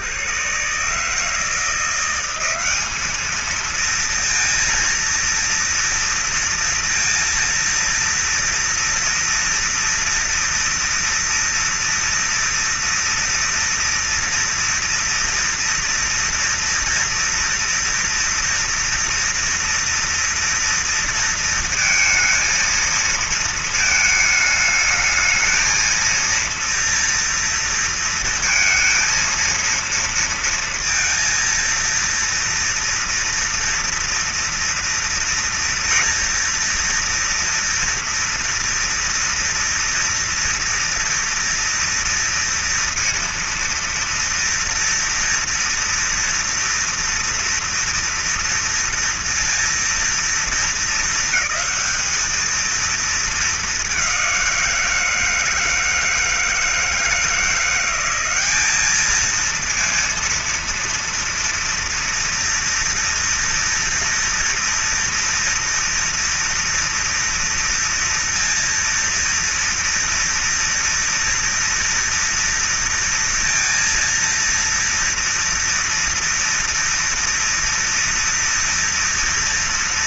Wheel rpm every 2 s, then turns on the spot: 130, 200, 230, 230, 230, 230, 230, 230, 230, 230, 230, 230, 220, 230, 230, 230, 230, 230, 230, 230, 230, 230, 230, 230, 230, 220, 220, 170, 160, 210, 230, 230, 240, 230, 230, 230, 230, 230, 240, 230.
none